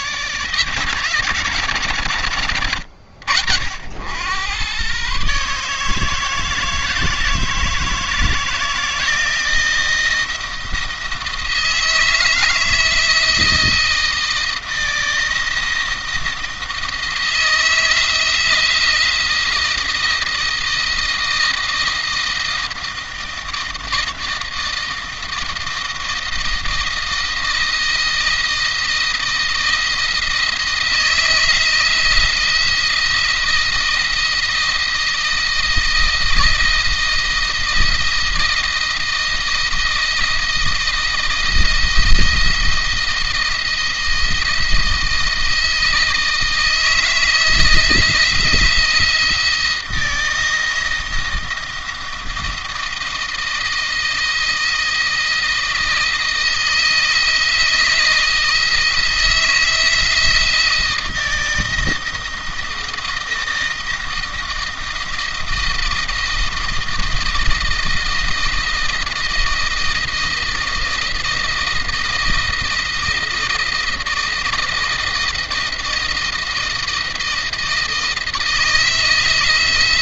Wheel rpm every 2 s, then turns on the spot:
130, 90, 120, 160, 160, 160, 160, 160, 170, 160, 160, 160, 160, 160, 170, 170, 170, 170, 170, 170, 170, 170, 160, 160, 170, 160, 170, 170, 160, 160, 170, 170, 160, 160, 160, 170, 160, 160, 160, 170.
none